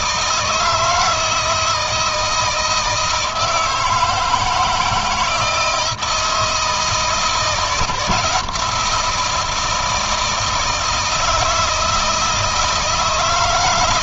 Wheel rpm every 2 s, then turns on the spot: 160, 170, 160, 160, 170, 160, 160.
none